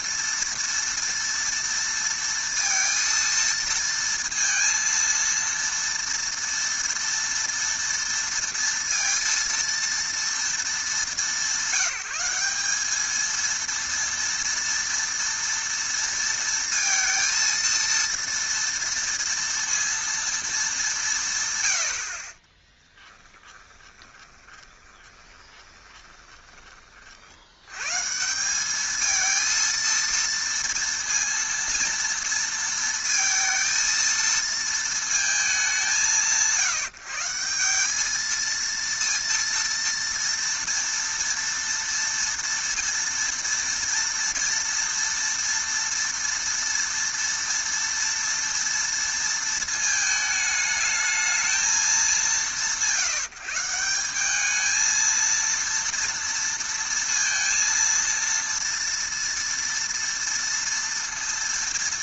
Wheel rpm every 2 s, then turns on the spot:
230, 230, 230, 230, 230, 210, 200, 230, 230, 230, 210, 20, 20, 30, 200, 230, 230, 220, 150, 230, 230, 230, 230, 230, 230, 220, 170, 220, 230, 230, 230.
22-26